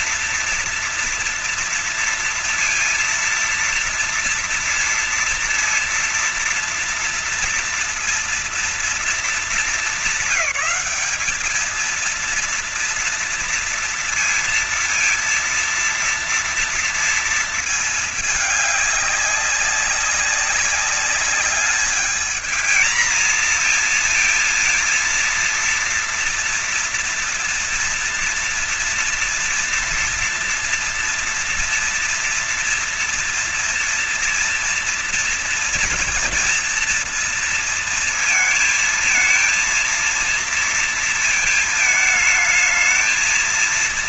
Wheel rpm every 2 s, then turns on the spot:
230, 230, 230, 230, 230, 230, 220, 230, 230, 230, 200, 210, 230, 230, 230, 230, 240, 230, 230, 230, 220, 220.
none